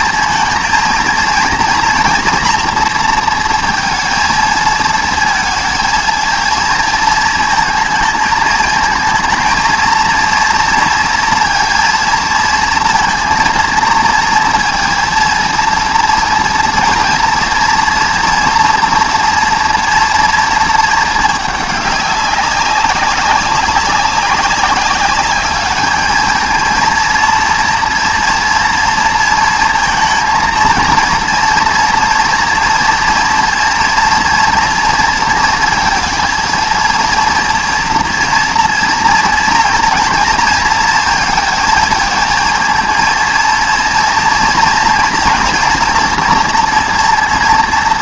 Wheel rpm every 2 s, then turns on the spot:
220, 240, 220, 220, 220, 230, 230, 230, 230, 240, 220, 200, 200, 230, 230, 230, 230, 230, 230, 230, 230, 230, 230, 240.
none